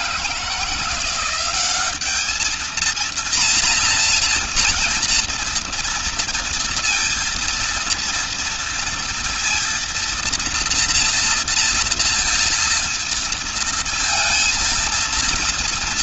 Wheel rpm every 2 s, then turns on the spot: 170, 220, 240, 230, 230, 230, 230, 230.
none